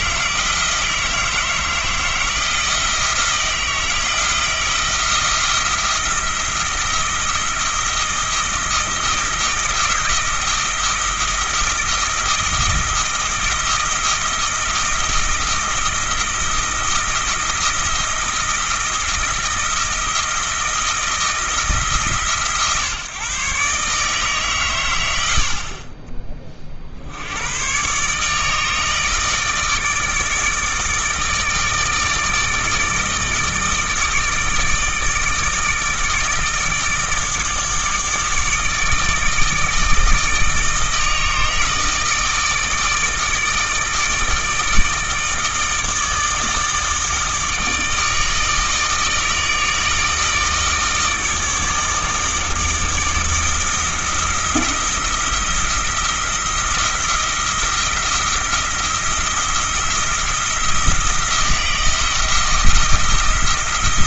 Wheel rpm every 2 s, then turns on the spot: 160, 160, 170, 170, 160, 160, 160, 160, 170, 160, 160, 140, 110, 60, 160, 160, 160, 160, 160, 160, 160, 160, 160, 160, 160, 160, 160, 170, 170, 170, 170, 170.
none